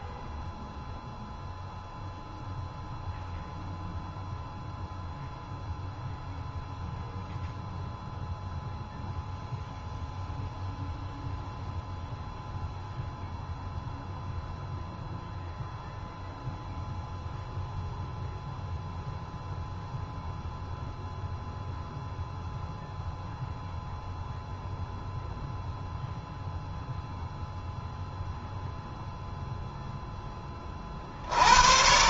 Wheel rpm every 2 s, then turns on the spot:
0, 0, 0, 0, 0, 0, 0, 0, 0, 0, 0, 0, 0, 0, 0, 40.
none